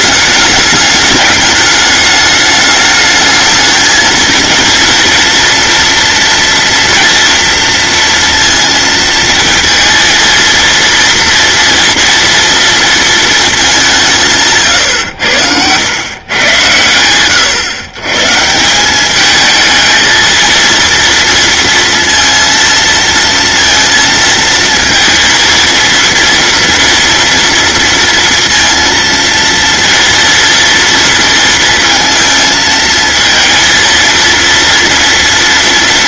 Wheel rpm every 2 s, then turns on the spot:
210, 220, 230, 230, 230, 230, 200, 90, 110, 220, 230, 230, 230, 230, 230, 230, 230, 230.
none